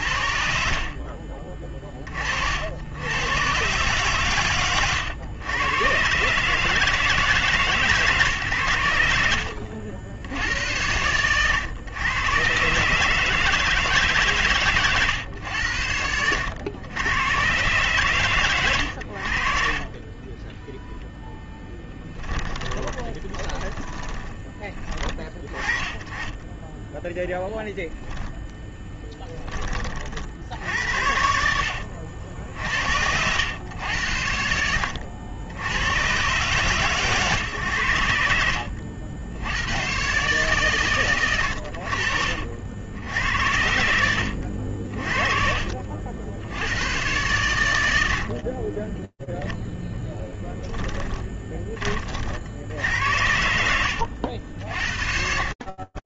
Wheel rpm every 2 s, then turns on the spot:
50, 70, 130, 150, 120, 110, 140, 130, 100, 80, 0, 20, 30, 10, 10, 70, 70, 80, 140, 70, 130, 80, 50, 120, 20, 30, 90, 30.
0-2 22-24 28-30 32-36 38-40 50-52